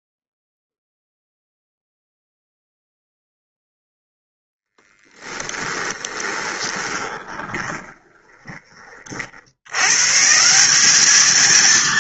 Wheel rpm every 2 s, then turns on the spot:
0, 0, 10, 20, 50, 210.
4-8